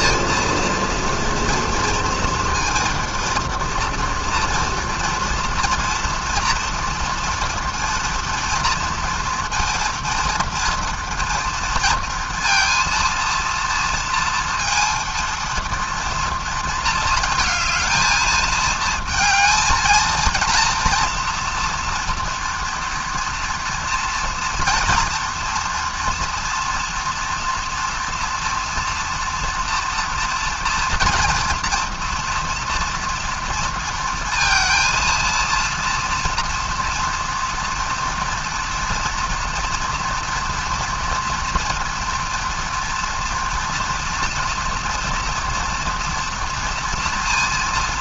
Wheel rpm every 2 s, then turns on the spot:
230, 230, 230, 230, 230, 230, 230, 230, 230, 220, 230, 230, 230, 230, 230, 230, 230, 230, 230, 240, 230, 230, 230, 230.
none